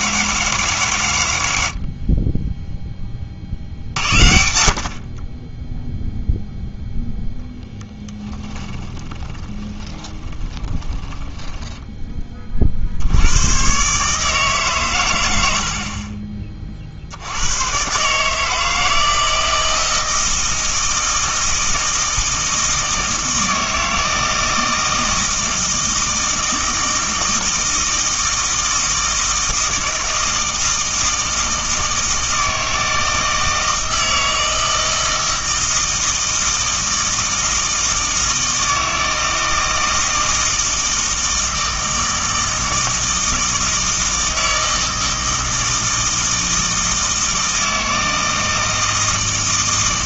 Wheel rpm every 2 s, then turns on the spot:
140, 10, 60, 0, 20, 20, 50, 150, 30, 160, 160, 160, 160, 160, 160, 160, 160, 160, 160, 160, 160, 160, 160, 160, 160.
8-12